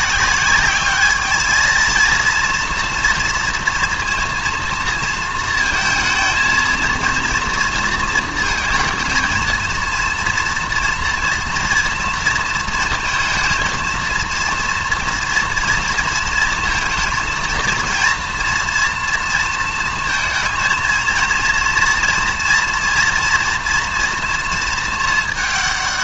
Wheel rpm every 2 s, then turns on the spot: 200, 230, 230, 220, 220, 230, 230, 240, 220, 230, 230, 230, 220.
none